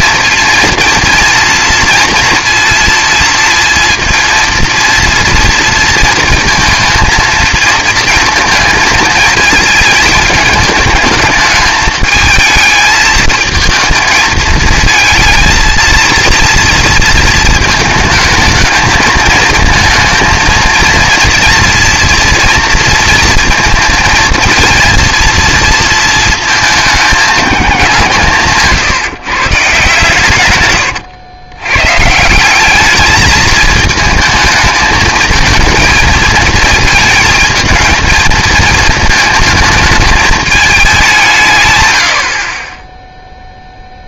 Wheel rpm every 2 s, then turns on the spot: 230, 230, 230, 220, 230, 220, 220, 220, 230, 220, 230, 230, 230, 210, 150, 120, 200, 220, 230, 220, 210, 20.
30-32